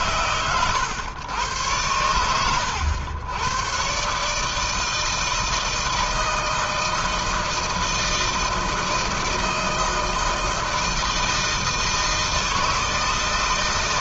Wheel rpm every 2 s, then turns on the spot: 110, 100, 160, 160, 160, 160, 160.
none